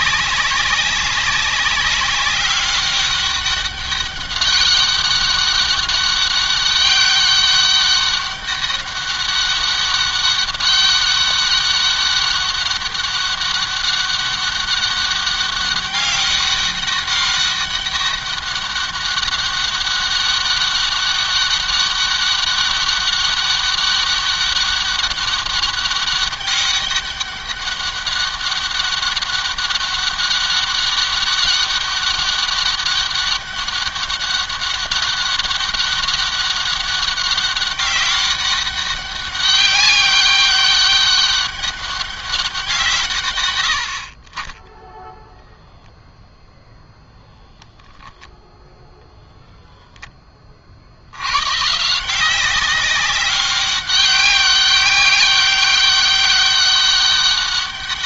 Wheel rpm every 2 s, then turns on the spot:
190, 200, 200, 200, 200, 200, 200, 200, 200, 200, 200, 200, 200, 200, 200, 200, 200, 200, 200, 200, 200, 160, 10, 0, 0, 50, 190, 200, 200.
none